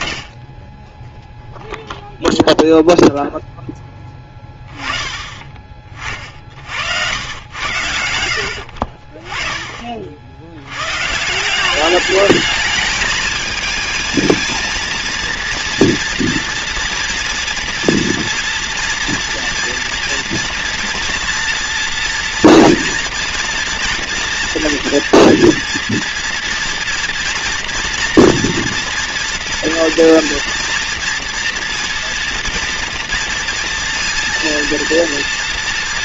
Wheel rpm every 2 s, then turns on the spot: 70, 0, 20, 70, 60, 120, 220, 230, 240, 230, 230, 230, 230, 240, 230, 240, 240, 230.
none